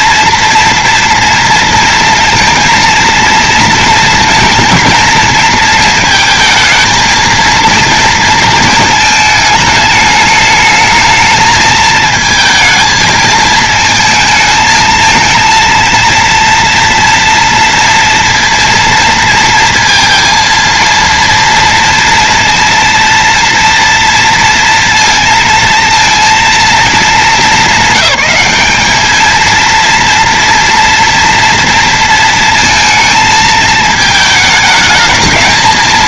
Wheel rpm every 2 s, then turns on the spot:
230, 230, 230, 230, 220, 220, 220, 220, 230, 230, 230, 230, 230, 220, 210, 230, 230, 220.
none